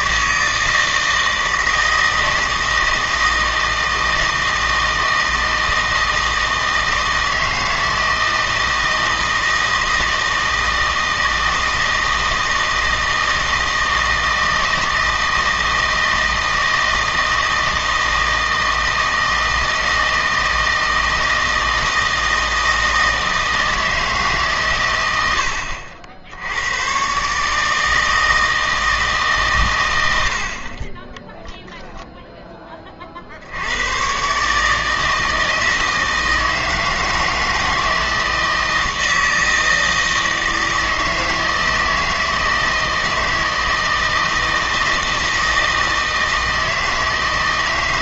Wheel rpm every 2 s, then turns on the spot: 160, 160, 160, 160, 160, 160, 160, 160, 160, 160, 160, 160, 130, 100, 160, 40, 20, 150, 160, 160, 160, 160, 160, 160.
none